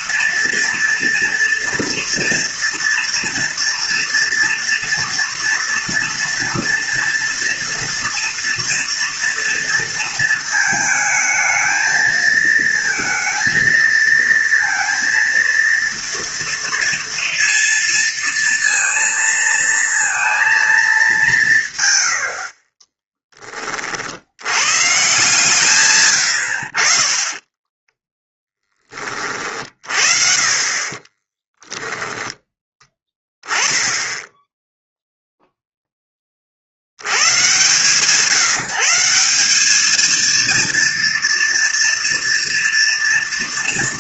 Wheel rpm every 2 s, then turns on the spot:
240, 230, 230, 230, 230, 220, 230, 230, 230, 230, 220, 30, 120, 70, 10, 30, 10, 0, 40, 170, 230, 230.
22-24 30-32